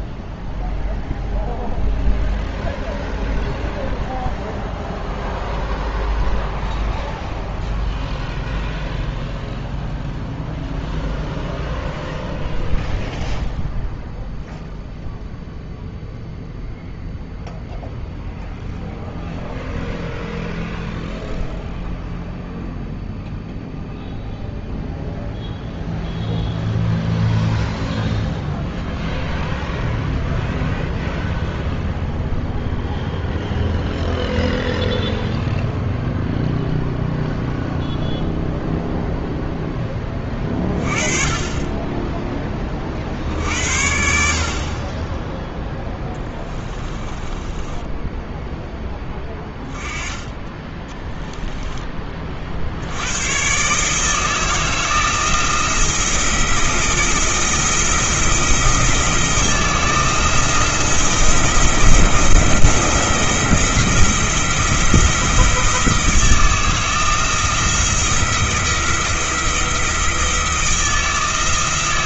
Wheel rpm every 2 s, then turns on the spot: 0, 0, 0, 0, 0, 0, 0, 0, 0, 0, 0, 0, 0, 0, 0, 0, 0, 0, 0, 0, 30, 30, 40, 20, 10, 20, 70, 160, 160, 160, 170, 170, 170, 160, 170, 160.
46-48 50-52